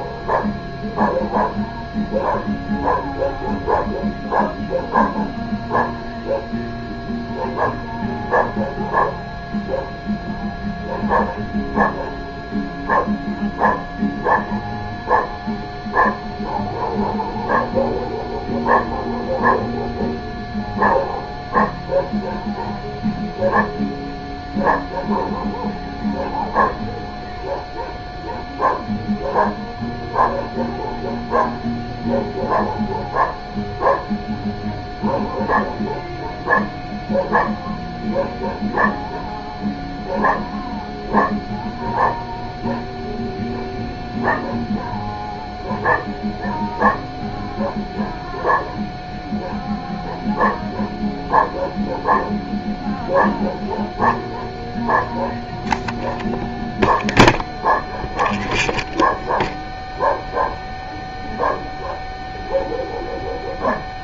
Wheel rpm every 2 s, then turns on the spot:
0, 0, 0, 0, 0, 0, 0, 0, 0, 0, 0, 0, 0, 0, 0, 0, 0, 0, 0, 0, 0, 0, 0, 0, 0, 0, 0, 0, 0, 0, 0, 0.
none